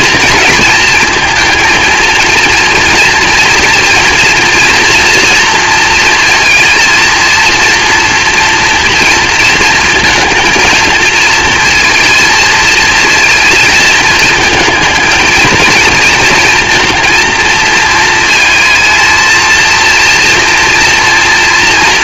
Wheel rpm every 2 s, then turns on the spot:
220, 230, 240, 230, 230, 230, 230, 230, 230, 230, 230.
none